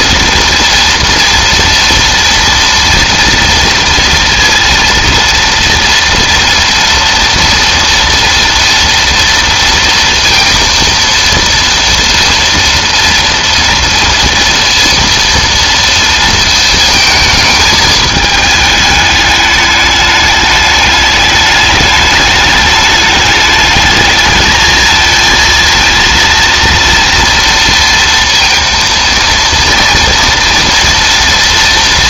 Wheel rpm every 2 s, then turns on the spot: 230, 230, 230, 230, 230, 230, 230, 230, 220, 210, 210, 210, 220, 230, 230, 240.
none